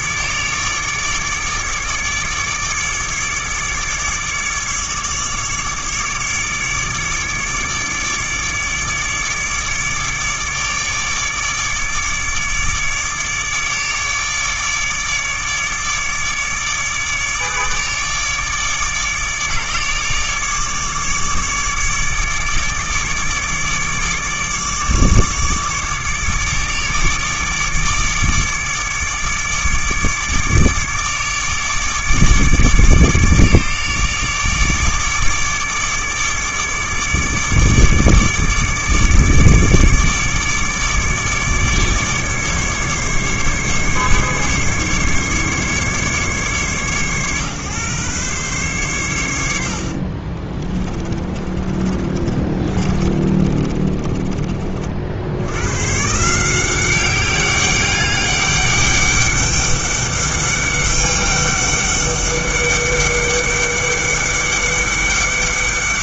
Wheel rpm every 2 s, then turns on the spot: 150, 150, 150, 150, 150, 150, 150, 150, 150, 150, 150, 150, 150, 150, 150, 150, 150, 150, 150, 150, 150, 140, 140, 130, 120, 40, 30, 50, 190, 200, 200, 200, 200.
50-54